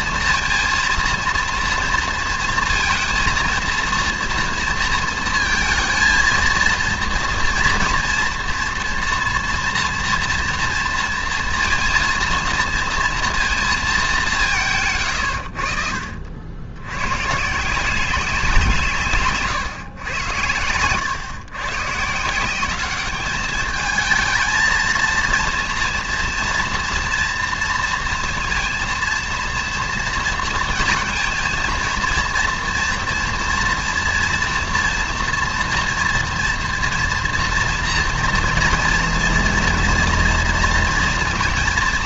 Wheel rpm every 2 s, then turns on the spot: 230, 230, 230, 230, 240, 240, 230, 160, 80, 170, 110, 190, 220, 230, 230, 230, 230, 230, 230, 230, 230.
none